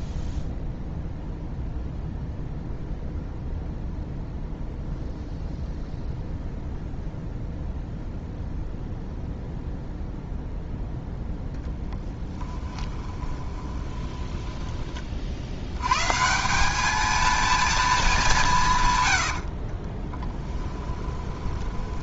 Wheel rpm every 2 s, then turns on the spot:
0, 0, 0, 0, 0, 0, 10, 20, 200, 160, 10.
12-14 20-22